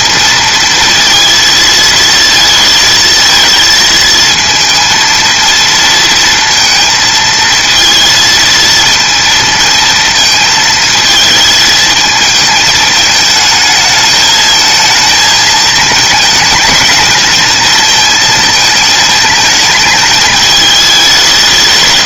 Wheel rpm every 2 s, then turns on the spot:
230, 220, 230, 230, 230, 220, 220, 220, 220, 220, 190.
none